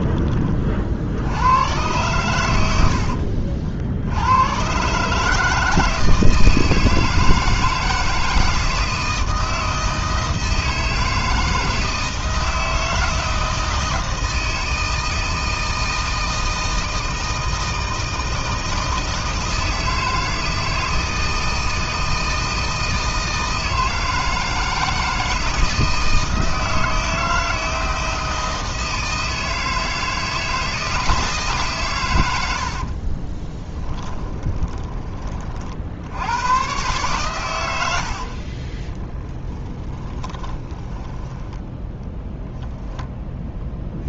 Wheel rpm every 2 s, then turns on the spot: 50, 80, 130, 160, 160, 160, 160, 160, 160, 160, 160, 160, 160, 160, 160, 160, 50, 20, 120, 30, 20, 0.
32-34 38-42